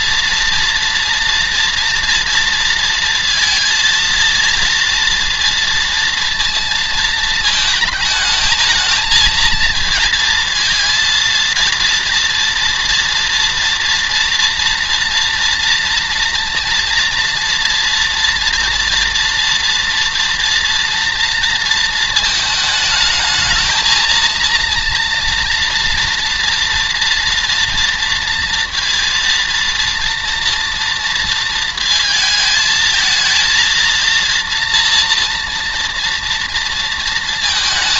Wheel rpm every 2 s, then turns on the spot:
230, 230, 230, 220, 210, 230, 230, 240, 240, 240, 240, 220, 230, 230, 230, 230, 220, 230, 230.
none